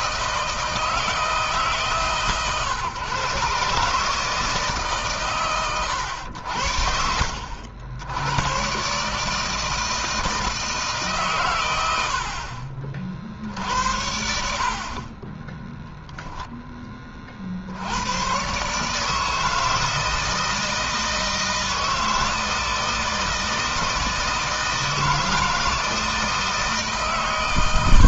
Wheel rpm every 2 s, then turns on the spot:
160, 130, 150, 80, 120, 160, 60, 50, 10, 130, 160, 160, 160, 150.
none